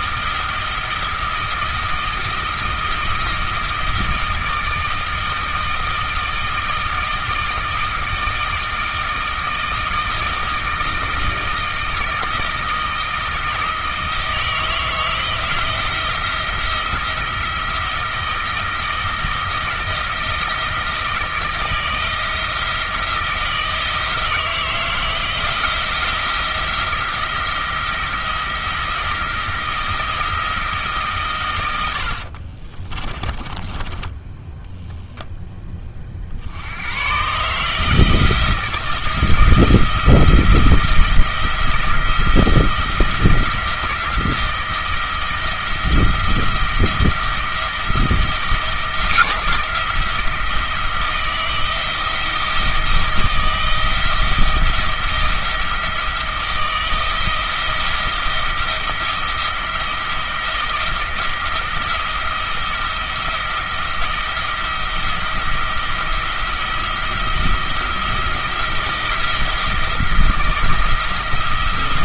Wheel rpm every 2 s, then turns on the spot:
170, 160, 160, 160, 160, 160, 160, 160, 170, 160, 160, 160, 160, 170, 170, 150, 30, 0, 90, 170, 170, 170, 160, 170, 160, 170, 170, 170, 170, 170, 160, 170, 170, 170, 170, 170.
32-34